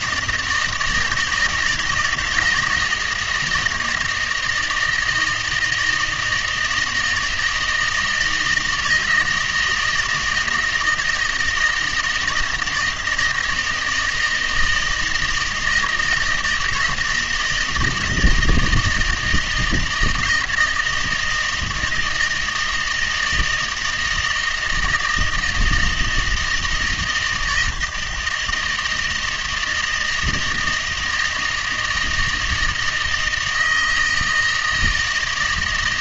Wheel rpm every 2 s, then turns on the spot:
160, 160, 160, 160, 160, 160, 160, 160, 160, 160, 170, 160, 160, 160, 160, 160, 160, 160.
none